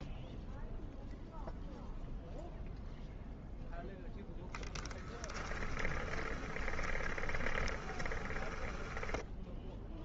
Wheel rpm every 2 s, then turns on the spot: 0, 0, 10, 20, 10.
4-10